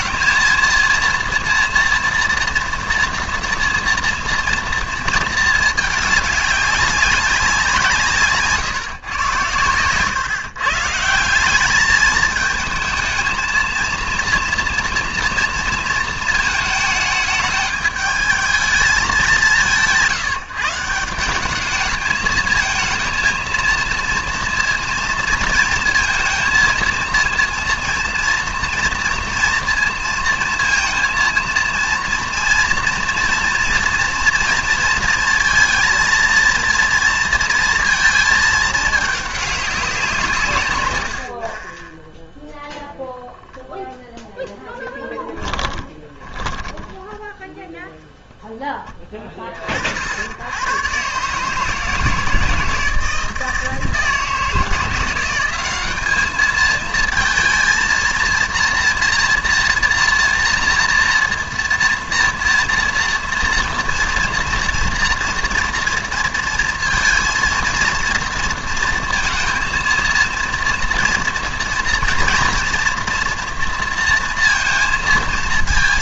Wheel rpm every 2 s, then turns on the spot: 230, 230, 230, 200, 140, 150, 220, 230, 220, 220, 160, 220, 230, 230, 230, 230, 230, 240, 230, 220, 140, 0, 10, 10, 20, 100, 160, 170, 220, 230, 240, 230, 230, 230, 230, 230, 230, 230.
46-48